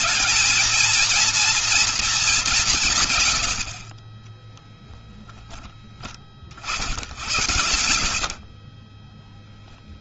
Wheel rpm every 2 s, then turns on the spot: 230, 170, 10, 60, 20.
8-10